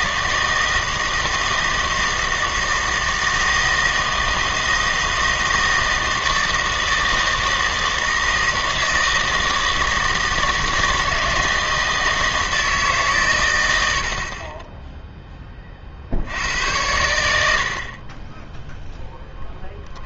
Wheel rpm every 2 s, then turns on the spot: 160, 160, 160, 160, 160, 160, 160, 20, 90, 10.
14-16